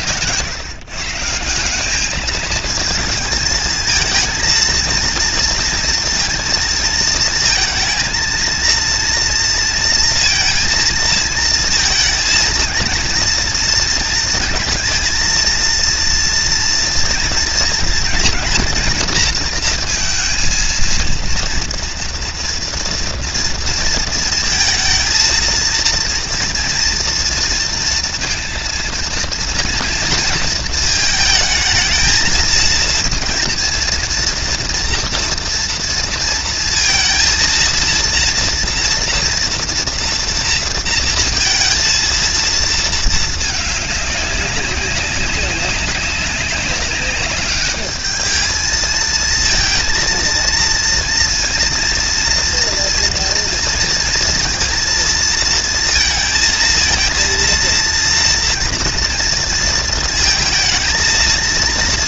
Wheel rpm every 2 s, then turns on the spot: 110, 200, 230, 230, 230, 230, 230, 230, 230, 230, 230, 230, 230, 230, 230, 230, 220, 230, 230, 230, 240, 230, 200, 200, 210, 230, 230, 230, 230, 230, 230.
none